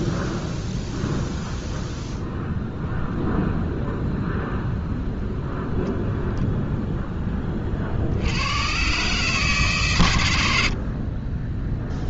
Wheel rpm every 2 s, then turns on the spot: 0, 0, 0, 0, 120, 50.
none